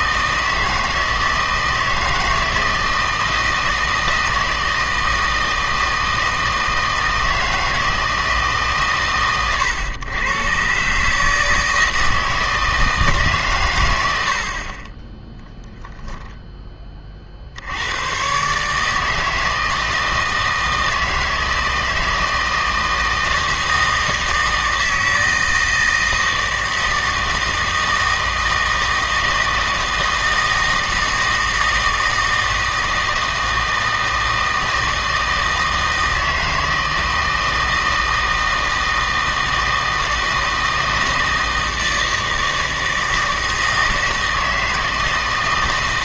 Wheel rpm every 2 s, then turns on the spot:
160, 160, 160, 160, 140, 130, 160, 40, 10, 150, 160, 160, 160, 160, 160, 160, 160, 160, 160, 160, 160, 160, 160.
none